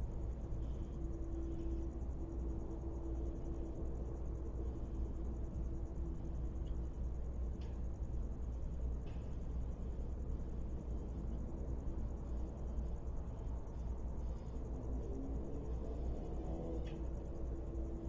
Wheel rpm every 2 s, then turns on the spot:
0, 0, 0, 0, 0, 0, 0, 0, 0.
none